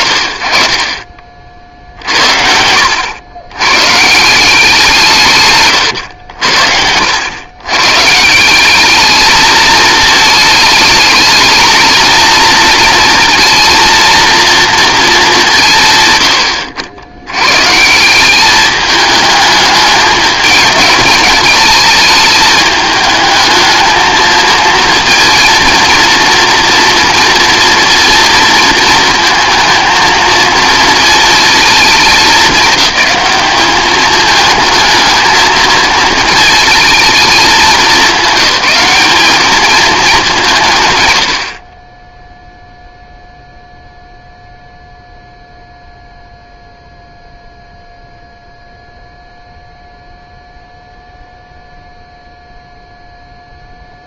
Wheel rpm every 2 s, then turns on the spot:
30, 80, 180, 70, 200, 220, 230, 230, 100, 210, 210, 210, 220, 230, 230, 220, 210, 220, 220, 180, 160, 0, 0, 0, 0, 0, 0.
none